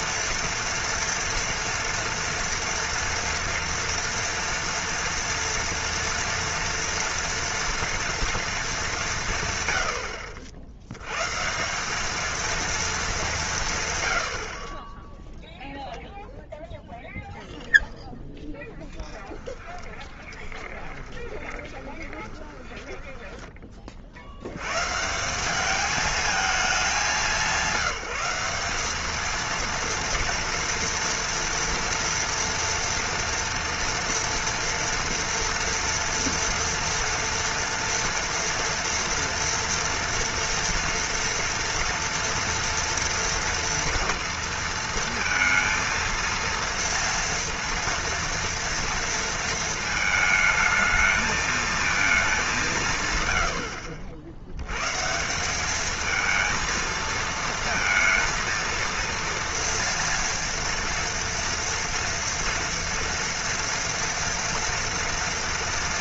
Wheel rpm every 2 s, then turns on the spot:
230, 230, 230, 230, 230, 70, 230, 50, 0, 0, 20, 20, 100, 220, 190, 230, 230, 230, 230, 240, 240, 230, 230, 230, 230, 220, 190, 90, 220, 230, 230, 240, 230.
20-24